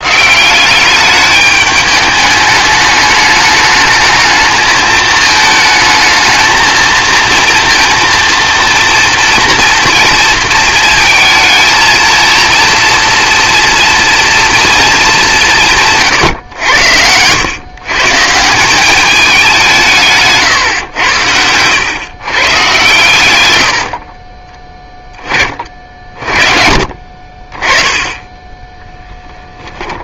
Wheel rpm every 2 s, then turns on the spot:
190, 210, 220, 220, 230, 220, 230, 230, 100, 180, 120, 130, 20, 50, 10.
none